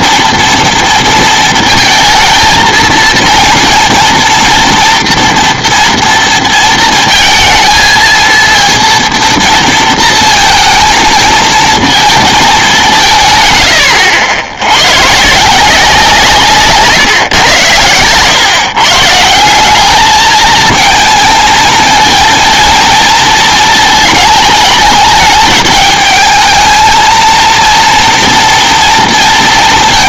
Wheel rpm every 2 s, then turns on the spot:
230, 230, 230, 230, 230, 220, 200, 100, 140, 140, 220, 230, 210, 220, 230.
none